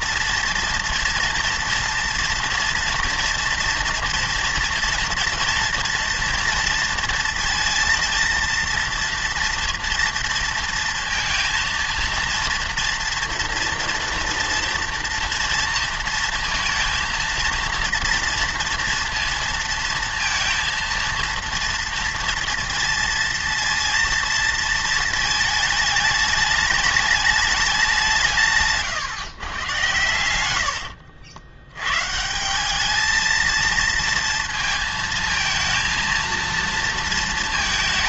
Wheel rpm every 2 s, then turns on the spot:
230, 230, 230, 230, 230, 230, 230, 230, 230, 230, 230, 230, 230, 210, 150, 90, 190, 230, 230.
28-32